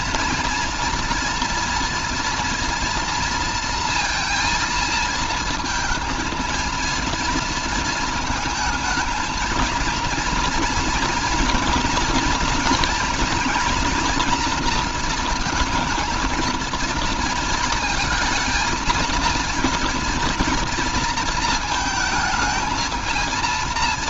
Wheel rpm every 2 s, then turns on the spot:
240, 230, 230, 230, 220, 230, 230, 230, 230, 230, 230, 220.
none